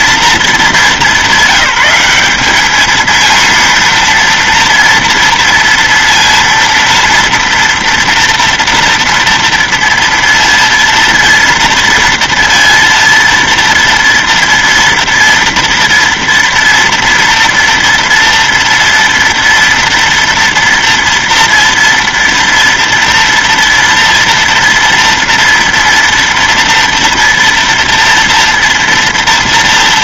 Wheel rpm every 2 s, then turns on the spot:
210, 200, 230, 230, 230, 230, 230, 230, 230, 230, 230, 230, 230, 230, 240.
none